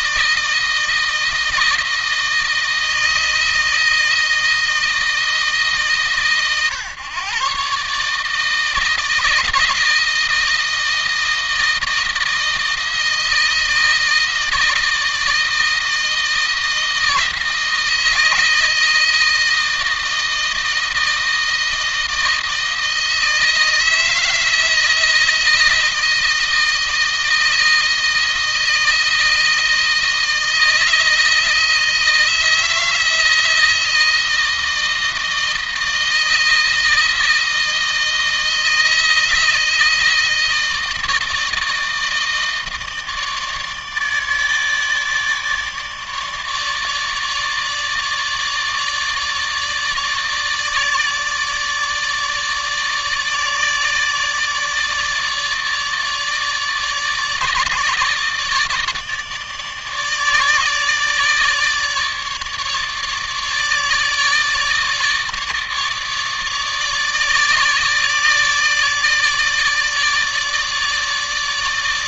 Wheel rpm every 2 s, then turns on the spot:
160, 160, 160, 140, 160, 160, 160, 160, 160, 160, 160, 160, 160, 160, 160, 160, 160, 160, 160, 160, 160, 160, 150, 150, 150, 150, 150, 160, 150, 150, 150, 150, 150, 150, 150, 150.
none